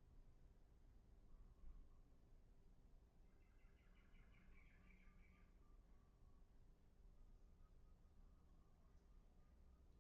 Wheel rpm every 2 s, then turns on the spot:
0, 0, 0, 0, 0.
none